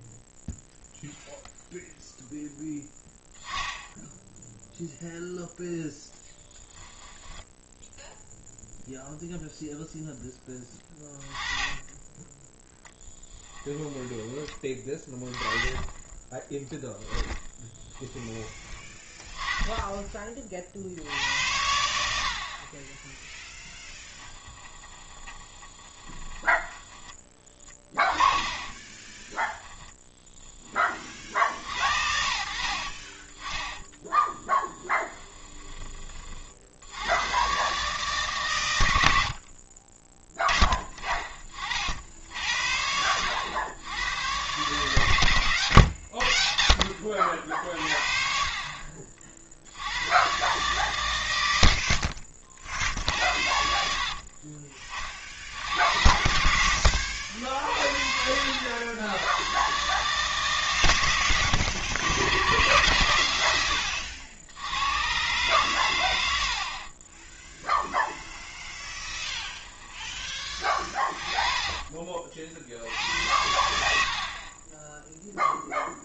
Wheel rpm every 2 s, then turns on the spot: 0, 0, 0, 20, 0, 20, 10, 20, 10, 20, 60, 30, 20, 20, 20, 30, 50, 20, 70, 110, 20, 80, 120, 60, 50, 130, 60, 40, 80, 90, 130, 130, 100, 40, 20, 20, 70, 20.
6-8 16-20 24-26 28-30 34-36 56-58 68-70 74-76